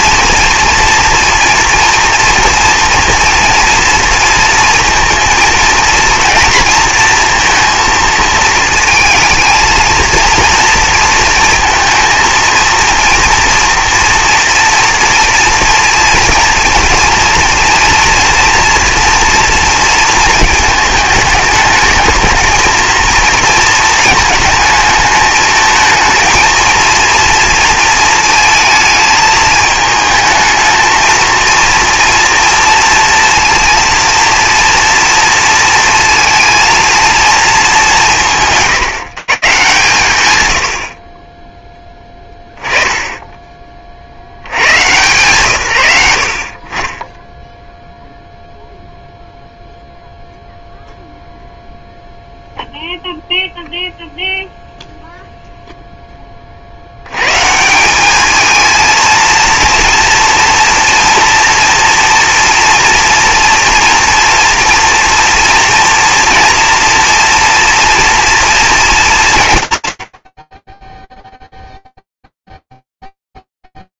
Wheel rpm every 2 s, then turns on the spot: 230, 230, 230, 230, 220, 230, 230, 230, 230, 230, 220, 220, 220, 230, 220, 220, 230, 230, 230, 190, 60, 10, 110, 40, 0, 0, 0, 0, 110, 230, 230, 230, 230, 230, 210, 10, 0.
none